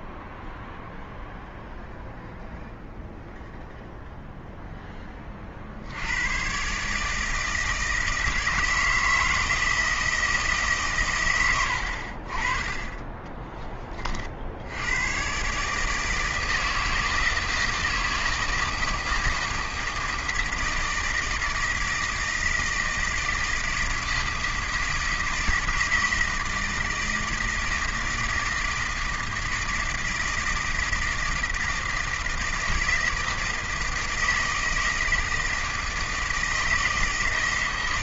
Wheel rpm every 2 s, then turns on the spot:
0, 0, 10, 140, 160, 140, 30, 100, 160, 160, 170, 160, 160, 160, 160, 160, 160, 160, 160.
none